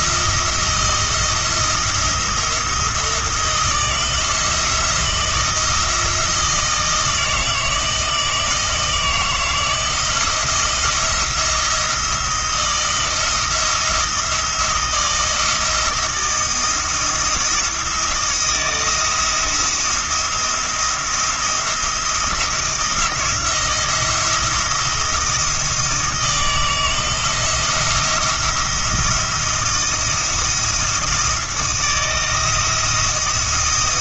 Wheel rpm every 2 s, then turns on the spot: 170, 170, 170, 160, 160, 170, 170, 160, 160, 170, 170, 170, 170, 160, 170, 160, 160.
none